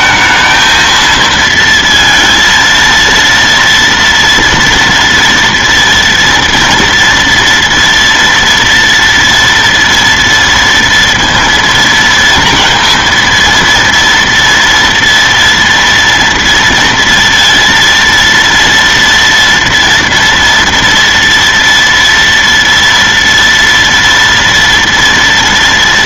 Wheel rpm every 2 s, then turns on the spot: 220, 230, 230, 230, 230, 230, 230, 230, 230, 230, 230, 230, 230.
none